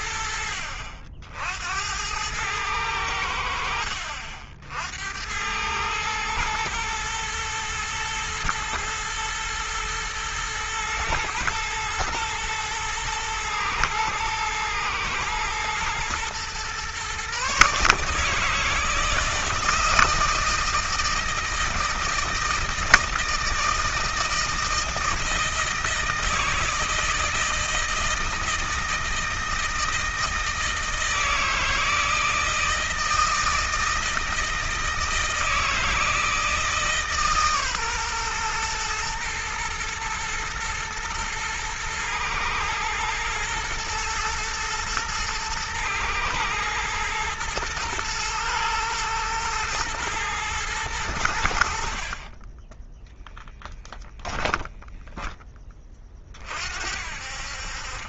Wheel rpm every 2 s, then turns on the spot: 70, 100, 70, 110, 110, 110, 110, 110, 120, 160, 160, 160, 160, 160, 160, 160, 160, 160, 160, 120, 110, 110, 110, 110, 120, 110, 20, 10, 60.
none